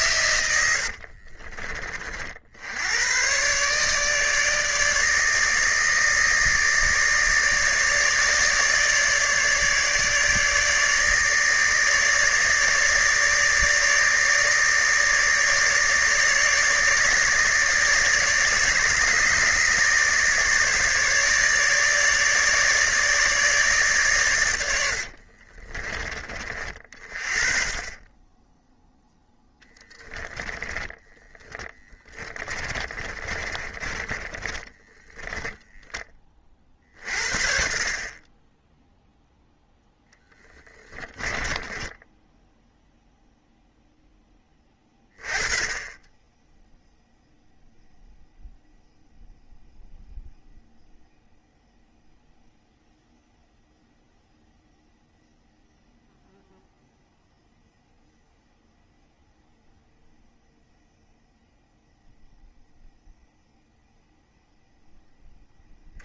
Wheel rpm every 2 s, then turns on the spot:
90, 90, 150, 150, 150, 150, 150, 150, 150, 150, 150, 150, 90, 40, 10, 10, 20, 10, 40, 0, 20, 0, 20, 0, 0, 0, 0, 0, 0, 0, 0, 0, 10.
0-2 24-26 30-36 40-42